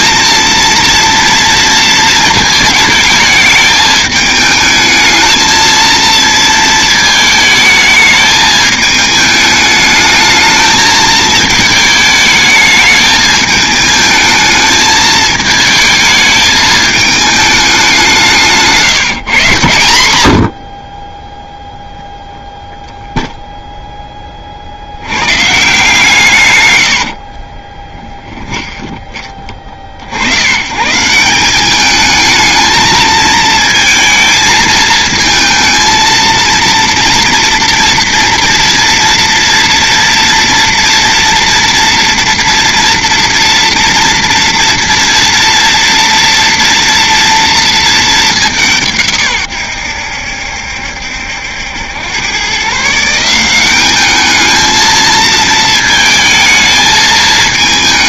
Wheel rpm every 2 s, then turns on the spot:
230, 220, 220, 230, 220, 220, 220, 220, 220, 170, 60, 0, 60, 110, 20, 130, 220, 230, 230, 230, 230, 230, 230, 230, 170, 70, 140, 220, 220.
18-20 26-30